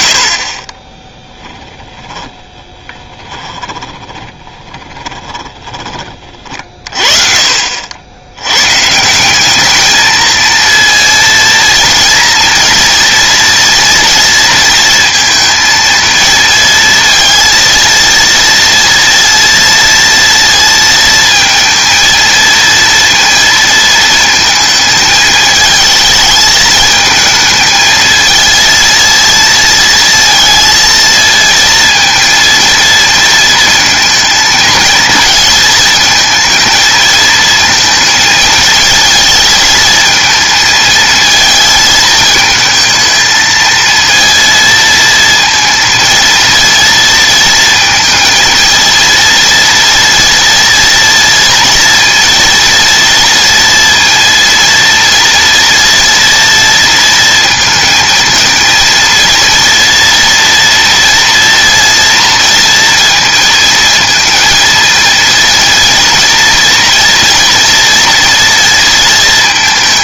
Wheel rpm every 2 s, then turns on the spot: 40, 10, 20, 40, 110, 230, 230, 230, 230, 230, 230, 230, 220, 220, 230, 230, 230, 220, 220, 220, 220, 220, 230, 230, 230, 230, 230, 230, 230, 230, 230, 230, 220, 230, 230.
2-8